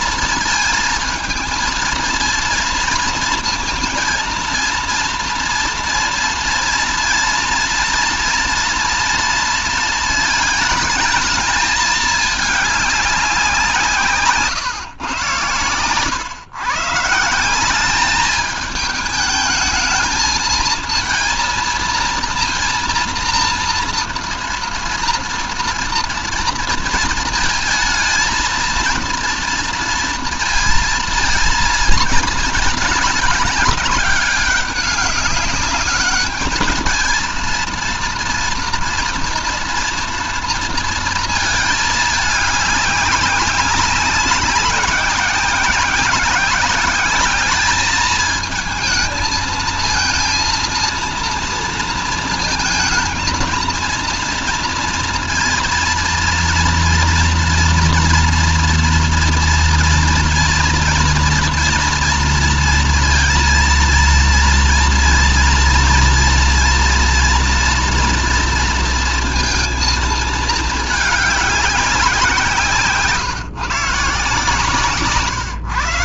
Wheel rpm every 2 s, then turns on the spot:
230, 230, 230, 230, 240, 220, 210, 130, 150, 210, 220, 230, 230, 230, 230, 230, 220, 200, 210, 240, 230, 200, 190, 200, 220, 230, 230, 230, 230, 230, 230, 230, 230, 230, 230, 210, 170, 150.
none